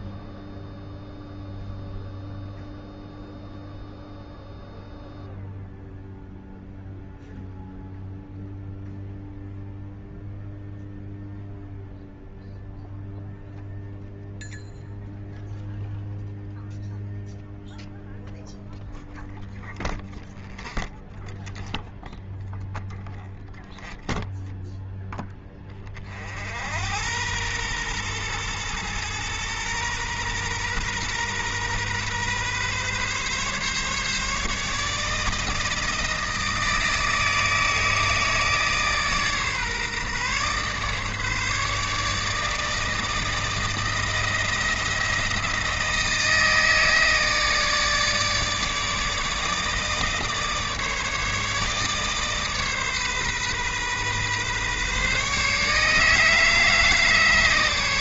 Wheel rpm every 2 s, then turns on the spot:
0, 0, 0, 0, 0, 0, 0, 0, 0, 0, 0, 0, 10, 80, 120, 120, 130, 150, 160, 150, 140, 160, 170, 160, 150, 150, 140, 140, 150.
none